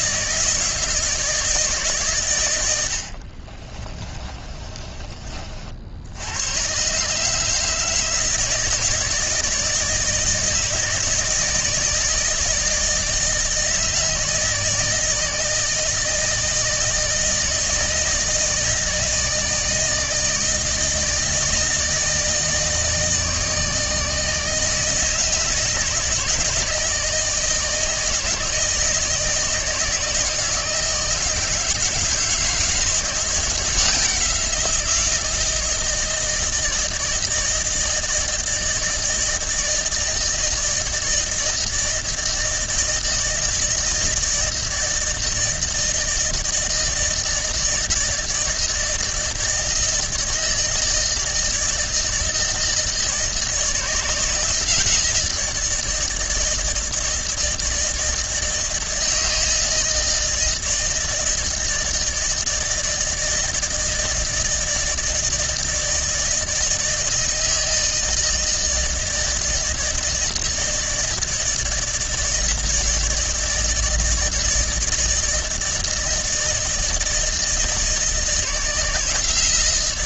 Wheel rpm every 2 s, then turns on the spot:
150, 80, 30, 120, 160, 160, 160, 160, 160, 160, 160, 160, 160, 150, 160, 160, 160, 170, 160, 160, 160, 160, 160, 160, 160, 160, 160, 160, 160, 160, 160, 160, 160, 160, 160, 160, 160, 160, 160, 160.
2-6